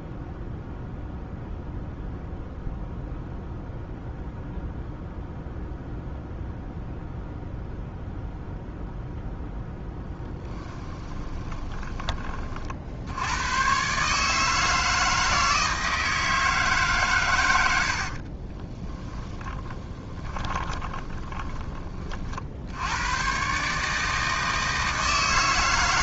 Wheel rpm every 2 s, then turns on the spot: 0, 0, 0, 0, 0, 20, 60, 160, 140, 20, 20, 80, 160.
10-12 18-22